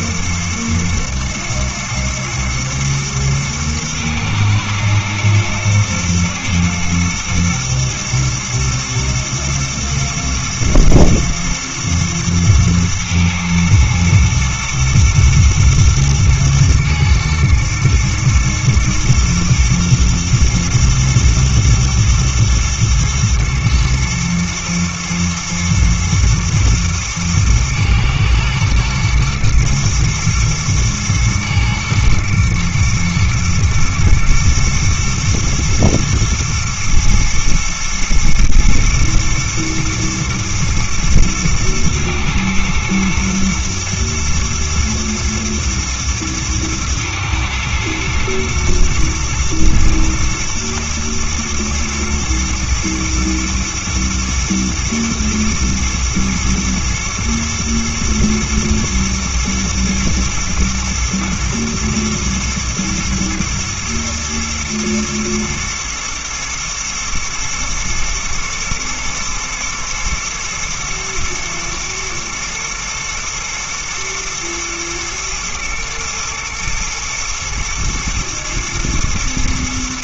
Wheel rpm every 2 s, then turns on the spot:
110, 110, 110, 110, 110, 110, 110, 120, 110, 110, 120, 120, 110, 120, 110, 110, 110, 120, 110, 120, 110, 120, 110, 110, 120, 110, 120, 110, 110, 110, 120, 110, 110, 110, 120, 110, 110, 120, 120, 110.
none